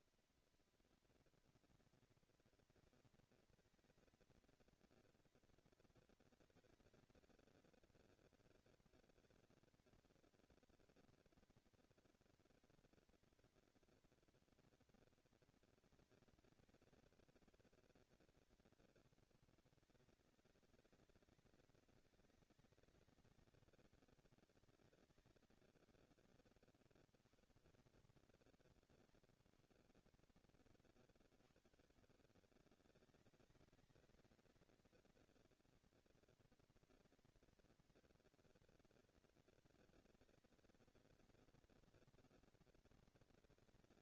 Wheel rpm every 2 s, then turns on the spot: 230, 230, 230, 230, 230, 230, 230, 230, 220, 210, 200, 190, 200, 90, 130, 170, 180, 220, 230, 230, 230, 230.
none